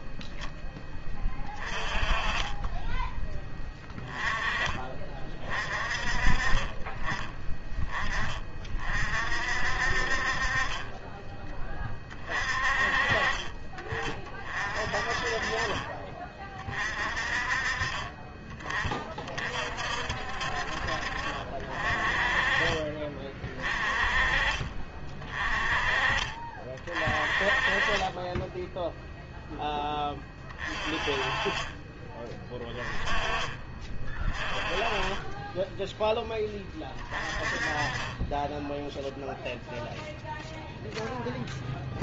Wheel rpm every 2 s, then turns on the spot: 10, 20, 30, 20, 50, 20, 40, 30, 30, 30, 50, 30, 30, 30, 0, 30, 20, 20, 30, 0, 0.
none